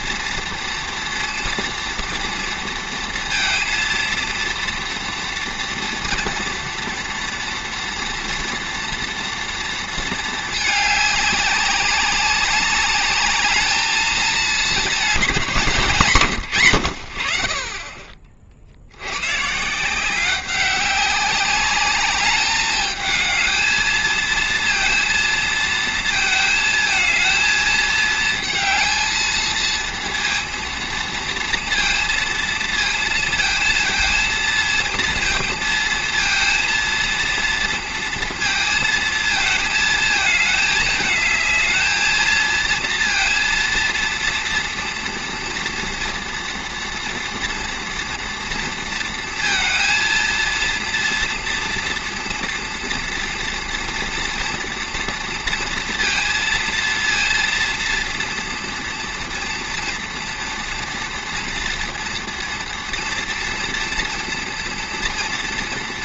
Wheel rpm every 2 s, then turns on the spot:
230, 230, 230, 230, 230, 210, 200, 220, 120, 60, 190, 210, 230, 220, 230, 230, 230, 230, 230, 230, 220, 230, 230, 230, 230, 230, 240, 240, 230, 240, 230, 230, 230.
none